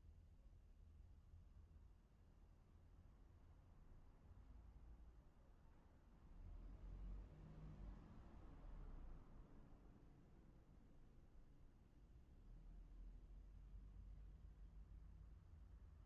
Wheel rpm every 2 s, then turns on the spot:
0, 0, 0, 0, 0, 0, 0, 0.
none